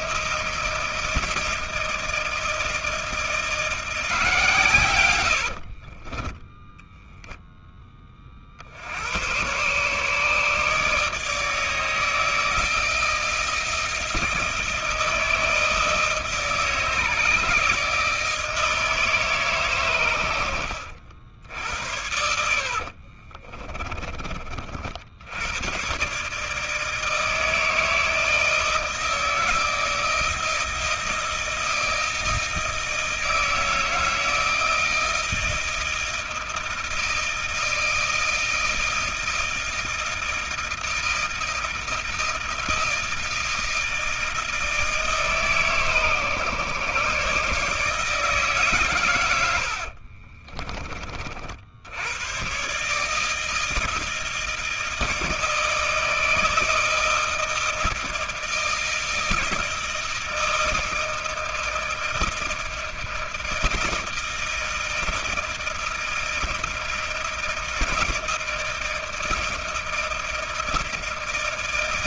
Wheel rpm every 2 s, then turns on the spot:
160, 160, 130, 10, 70, 150, 160, 160, 160, 160, 90, 60, 40, 150, 160, 160, 160, 160, 160, 160, 160, 160, 160, 130, 140, 30, 130, 160, 160, 160, 160, 160, 160, 160, 160, 160.
4-8 22-24